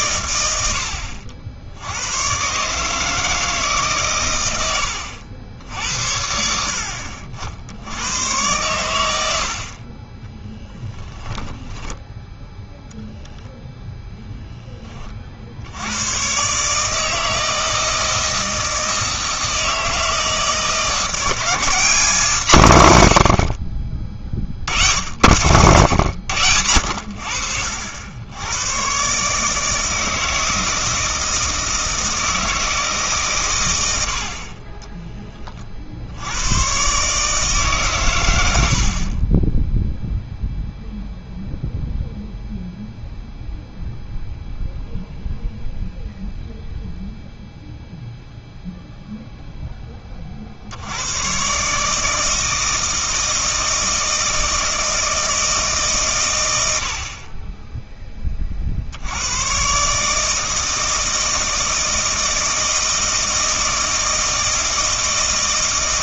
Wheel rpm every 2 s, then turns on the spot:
80, 140, 100, 70, 110, 10, 0, 20, 150, 160, 160, 140, 60, 80, 110, 160, 160, 30, 110, 60, 0, 0, 0, 0, 0, 70, 160, 160, 90, 40, 160, 160, 160.
10-12